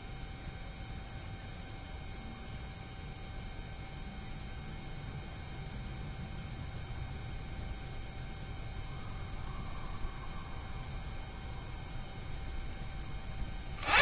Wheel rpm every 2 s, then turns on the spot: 0, 0, 0, 0, 0, 0, 0.
none